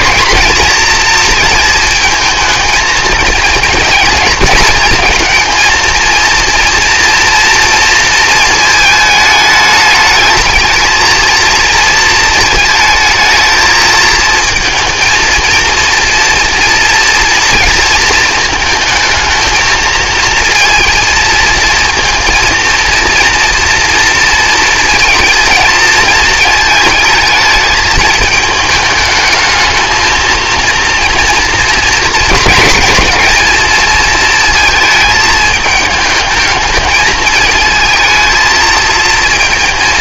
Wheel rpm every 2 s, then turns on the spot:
230, 220, 220, 230, 220, 220, 220, 220, 230, 220, 230, 230, 230, 220, 220, 230, 220, 220, 210, 220.
none